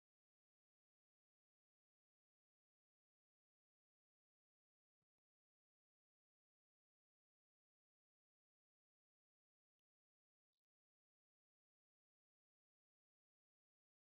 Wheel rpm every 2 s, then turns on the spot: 0, 0, 0, 0, 0, 0, 0.
none